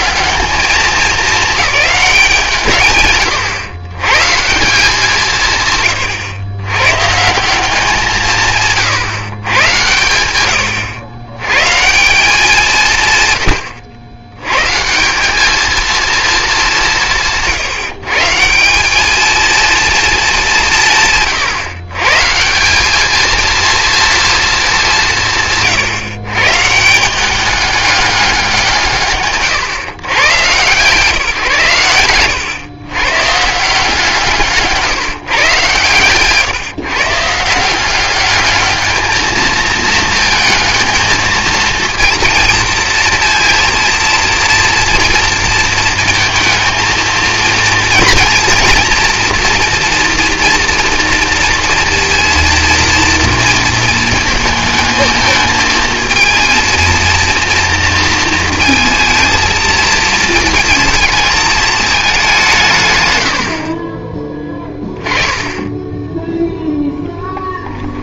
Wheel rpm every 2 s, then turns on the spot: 210, 150, 170, 120, 150, 90, 150, 170, 180, 200, 160, 210, 190, 160, 140, 150, 130, 150, 150, 220, 220, 230, 230, 230, 230, 230, 230, 220, 230, 230, 230, 120, 10, 0.
none